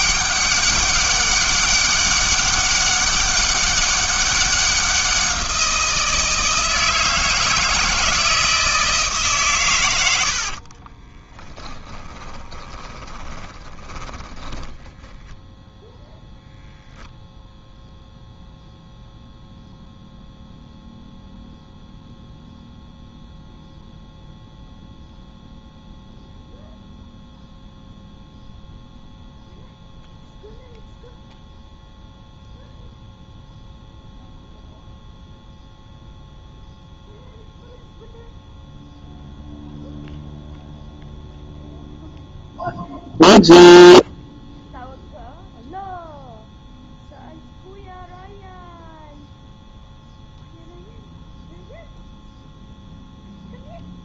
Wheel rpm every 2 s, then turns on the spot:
200, 200, 190, 160, 160, 50, 20, 10, 0, 0, 0, 0, 0, 0, 0, 0, 0, 0, 0, 0, 0, 0, 0, 0, 0, 0, 0.
10-16